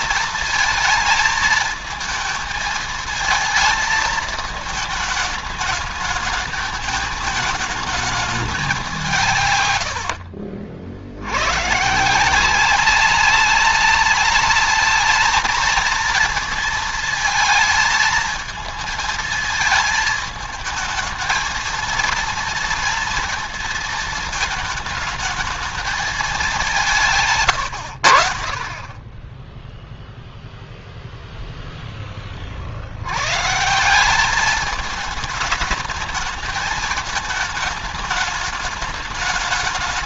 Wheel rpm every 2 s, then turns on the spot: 220, 220, 220, 220, 200, 60, 180, 210, 230, 220, 220, 230, 220, 180, 30, 0, 60, 210, 210, 210.
none